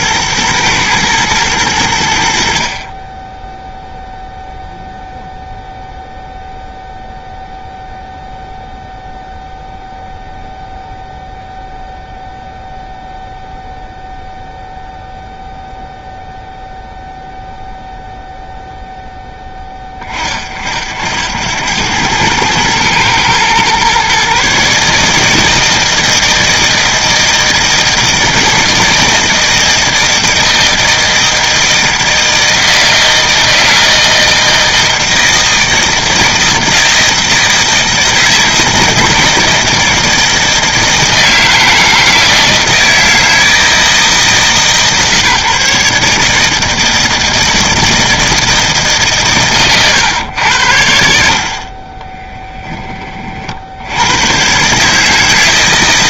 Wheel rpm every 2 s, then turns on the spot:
120, 50, 0, 0, 0, 0, 0, 0, 0, 0, 60, 110, 150, 160, 160, 160, 160, 160, 160, 160, 160, 160, 150, 160, 150, 80, 20, 140.
none